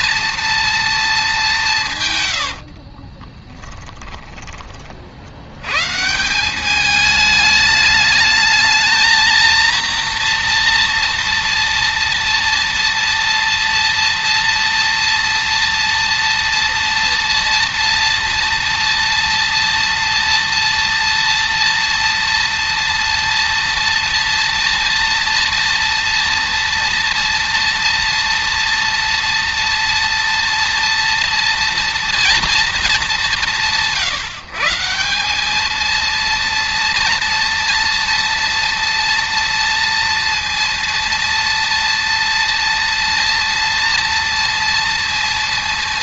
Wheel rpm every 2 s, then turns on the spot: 10, 140, 210, 230, 230, 230, 230, 230, 230, 230, 230, 230, 230, 230, 230, 130, 220, 230, 230, 230, 230, 230, 210.
0-2